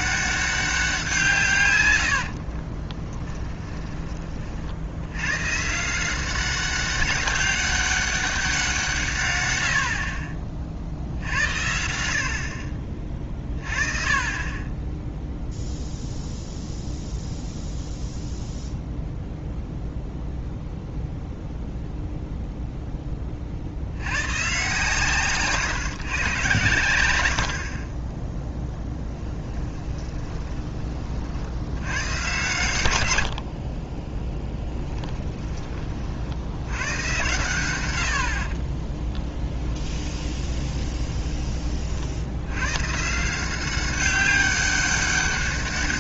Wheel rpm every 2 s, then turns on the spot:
190, 50, 60, 190, 180, 50, 50, 20, 0, 0, 0, 0, 130, 110, 10, 20, 120, 10, 90, 30, 20, 120, 200.
2-4 34-36 38-42